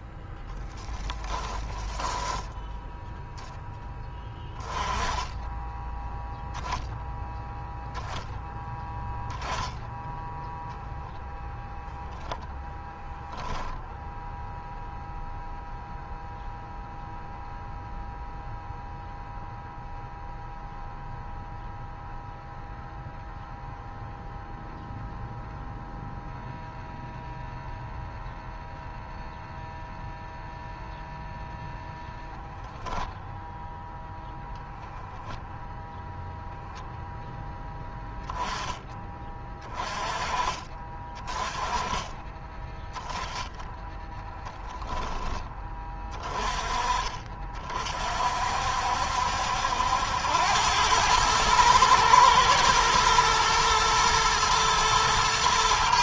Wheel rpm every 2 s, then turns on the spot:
0, 10, 10, 0, 10, 0, 10, 0, 0, 0, 0, 0, 0, 0, 0, 0, 0, 0, 0, 10, 30, 10, 10, 30, 50, 90, 110, 120.
2-4 44-46